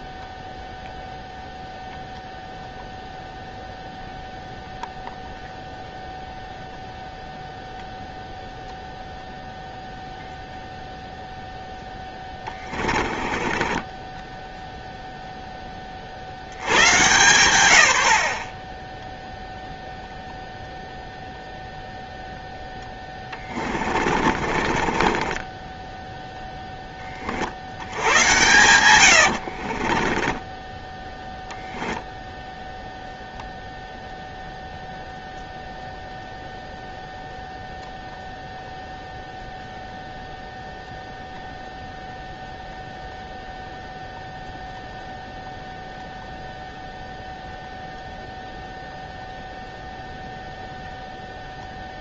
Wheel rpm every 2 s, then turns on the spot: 0, 0, 0, 0, 0, 0, 10, 10, 60, 40, 0, 0, 40, 10, 100, 20, 0, 0, 0, 0, 0, 0, 0, 0, 0, 0.
12-16 24-26 30-32